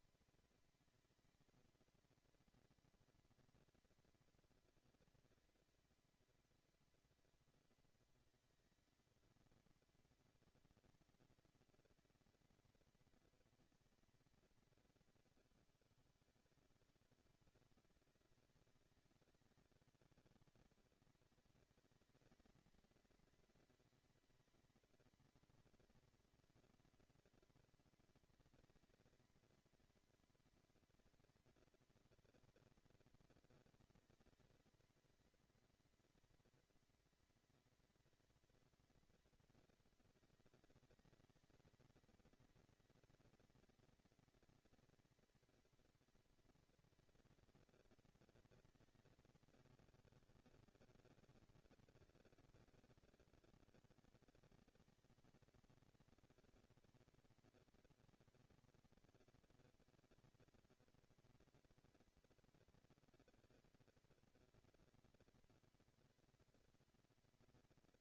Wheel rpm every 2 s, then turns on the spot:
230, 230, 230, 230, 230, 230, 230, 220, 180, 200, 210, 220, 230, 230, 230, 230, 230, 230, 230, 230, 220, 230, 230, 230, 230, 200, 200, 210, 230, 230, 230, 230, 230, 230.
none